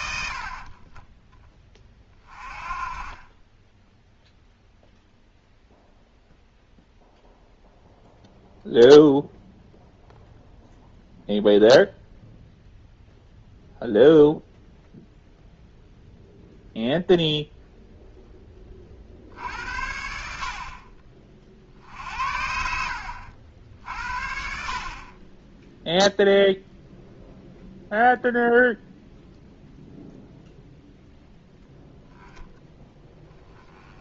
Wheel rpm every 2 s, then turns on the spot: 40, 30, 0, 0, 0, 0, 0, 0, 0, 20, 50, 60, 50, 0, 0, 0, 10.
22-24